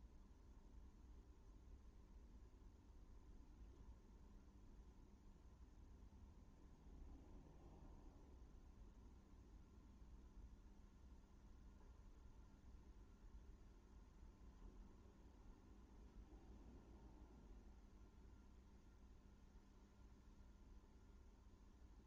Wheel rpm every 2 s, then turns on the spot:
0, 0, 0, 0, 0, 0, 0, 0, 0, 0, 0.
none